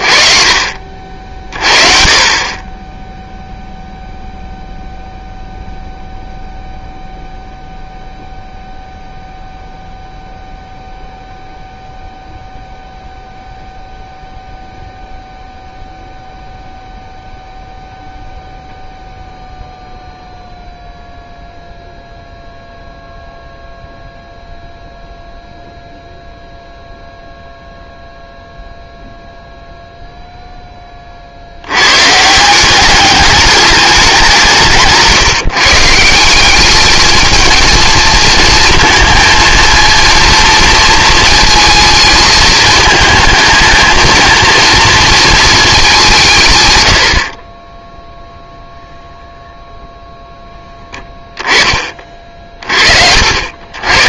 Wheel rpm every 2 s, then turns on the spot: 40, 20, 0, 0, 0, 0, 0, 0, 0, 0, 0, 0, 0, 0, 0, 20, 190, 160, 210, 230, 230, 220, 230, 110, 0, 10, 50.
none